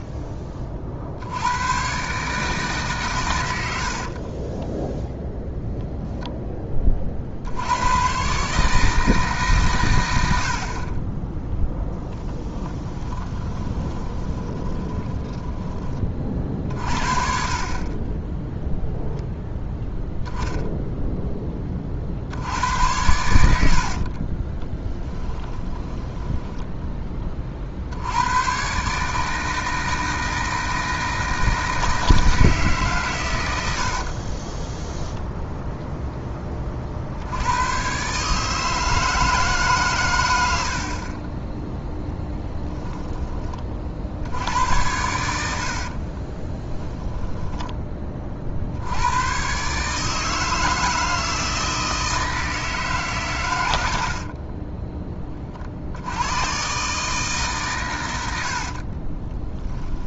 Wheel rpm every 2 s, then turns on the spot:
40, 140, 10, 30, 160, 50, 20, 20, 40, 0, 0, 90, 20, 10, 140, 160, 160, 10, 40, 150, 40, 10, 90, 10, 80, 160, 150, 20, 130, 50.
4-6 12-16 24-26 34-36 42-44 46-48 54-56 58-60